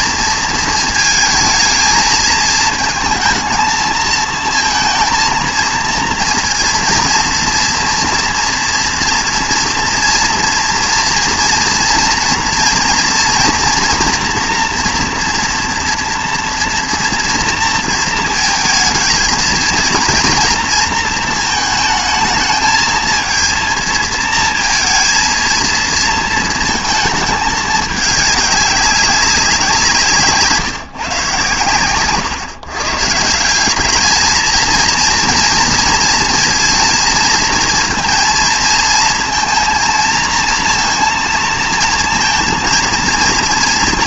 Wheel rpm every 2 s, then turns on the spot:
230, 220, 230, 230, 230, 230, 230, 230, 230, 220, 230, 220, 220, 230, 200, 160, 130, 220, 230, 230, 220, 230.
none